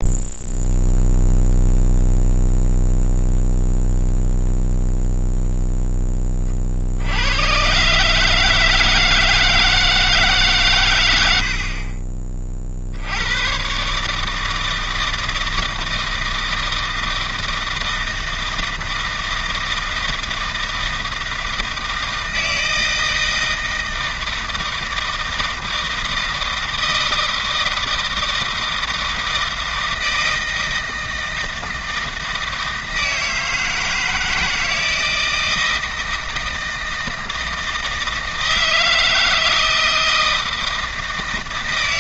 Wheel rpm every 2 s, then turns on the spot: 0, 0, 0, 90, 160, 80, 100, 160, 160, 160, 160, 160, 160, 160, 160, 160, 160, 160, 160, 160, 160.
none